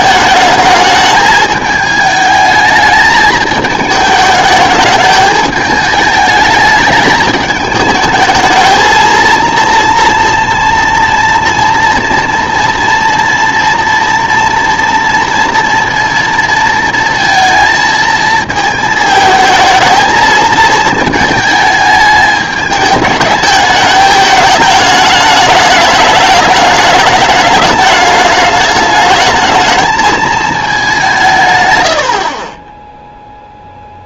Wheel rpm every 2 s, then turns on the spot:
220, 220, 210, 210, 220, 230, 230, 230, 230, 220, 220, 210, 210, 210, 210, 200, 10.
none